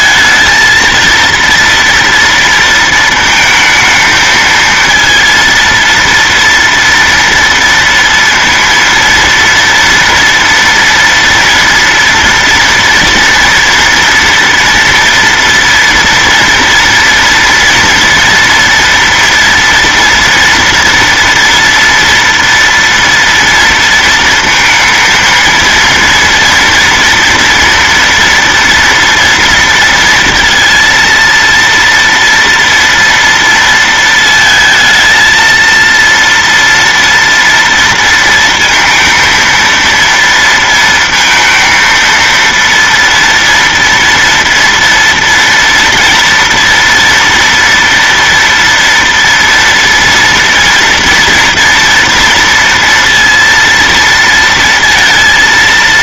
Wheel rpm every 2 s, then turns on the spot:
230, 230, 230, 230, 230, 240, 230, 230, 230, 230, 230, 230, 230, 230, 240, 230, 240, 220, 230, 230, 230, 230, 230, 230, 230, 230, 230, 230.
none